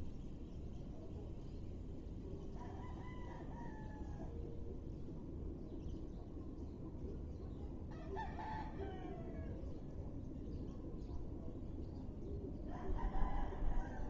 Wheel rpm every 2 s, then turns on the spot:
0, 0, 0, 0, 0, 0, 0.
none